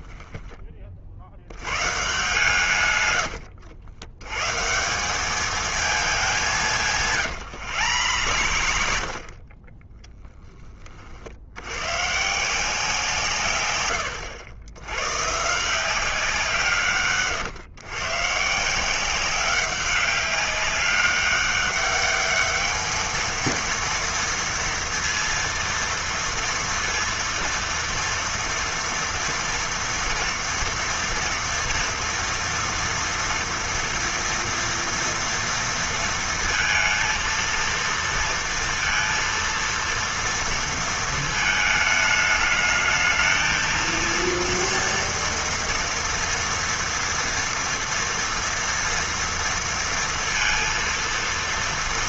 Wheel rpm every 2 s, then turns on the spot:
40, 130, 150, 170, 80, 20, 160, 100, 170, 160, 190, 210, 230, 230, 230, 230, 230, 230, 230, 230, 230, 220, 230, 240, 230, 230.
0-2 6-10